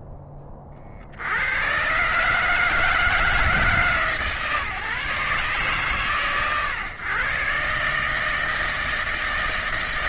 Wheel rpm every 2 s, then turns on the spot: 20, 150, 150, 110, 160.
none